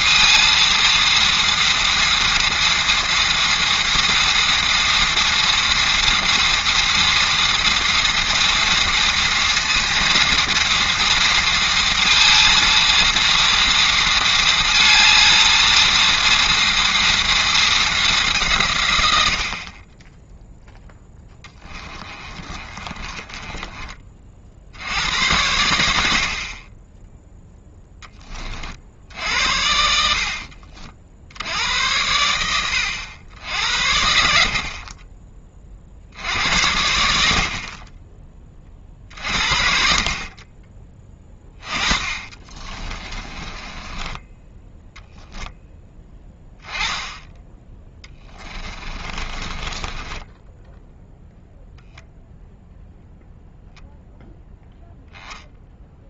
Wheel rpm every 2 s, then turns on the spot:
230, 230, 230, 230, 230, 230, 230, 220, 230, 120, 10, 30, 80, 20, 60, 60, 80, 30, 90, 40, 20, 20, 10, 10, 20, 0, 0, 0.
22-24 42-44 48-50